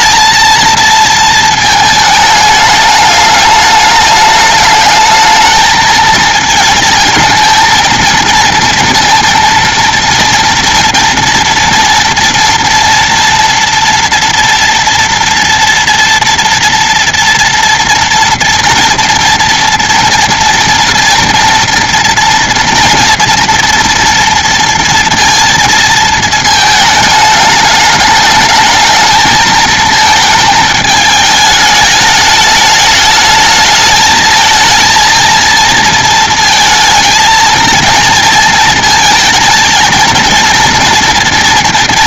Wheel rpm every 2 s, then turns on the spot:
230, 210, 210, 220, 230, 240, 230, 240, 240, 240, 230, 230, 230, 210, 220, 210, 210, 220, 220, 230, 230.
none